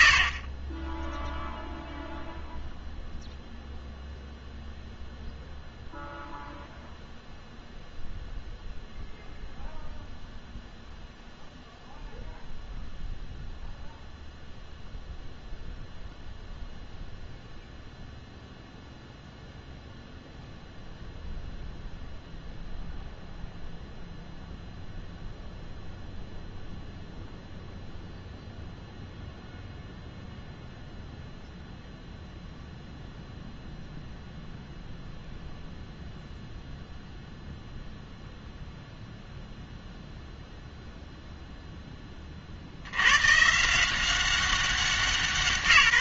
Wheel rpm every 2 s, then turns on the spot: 70, 0, 0, 0, 0, 0, 0, 0, 0, 0, 0, 0, 0, 0, 0, 0, 0, 0, 0, 0, 0, 70, 190.
none